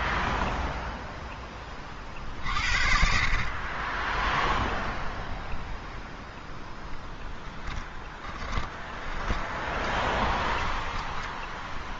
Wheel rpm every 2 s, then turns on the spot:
0, 50, 0, 10, 20, 10.
8-12